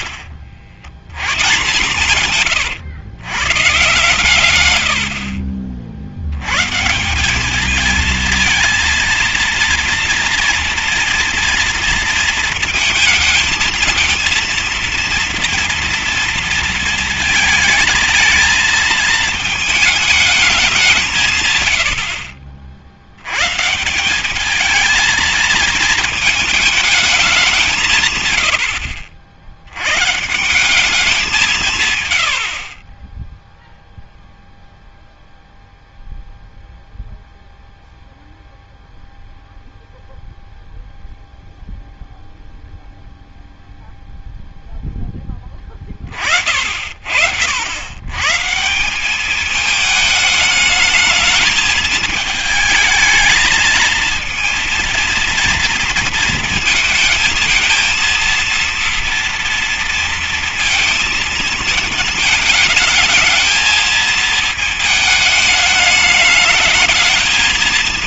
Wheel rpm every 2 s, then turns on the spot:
80, 110, 100, 150, 230, 230, 230, 230, 230, 220, 190, 50, 210, 220, 90, 180, 60, 0, 0, 0, 0, 0, 0, 50, 150, 210, 220, 230, 230, 230, 230, 220, 220, 210.
none